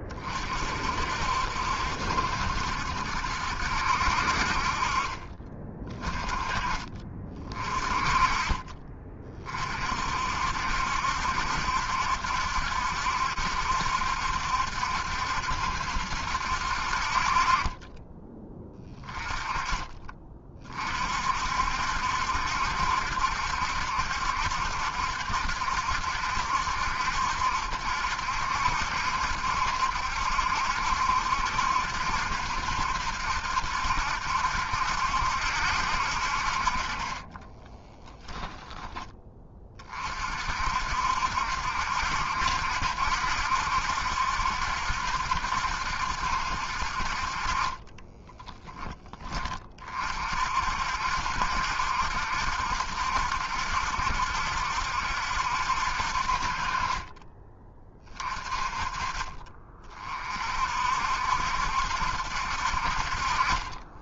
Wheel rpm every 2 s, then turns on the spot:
40, 70, 50, 30, 30, 60, 70, 70, 70, 20, 30, 70, 70, 70, 70, 70, 70, 70, 50, 10, 50, 70, 70, 70, 20, 50, 70, 70, 50, 40, 40, 70.
48-50